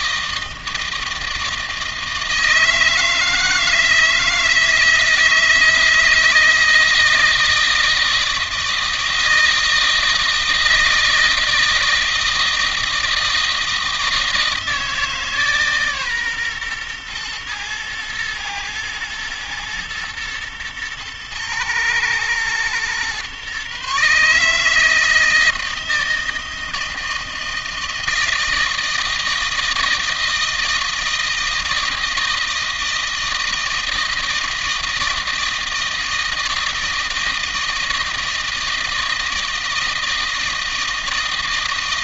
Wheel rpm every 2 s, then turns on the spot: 160, 160, 160, 160, 160, 160, 160, 160, 120, 110, 110, 120, 160, 160, 160, 160, 160, 160, 160, 160, 160.
none